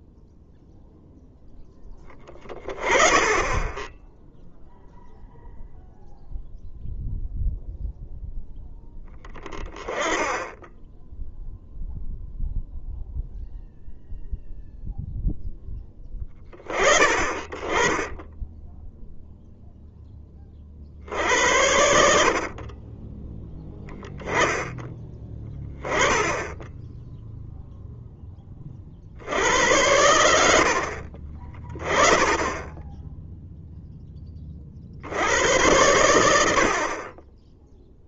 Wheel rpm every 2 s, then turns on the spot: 0, 20, 0, 0, 10, 10, 0, 0, 30, 0, 60, 20, 10, 10, 40, 70, 10, 70, 40.
none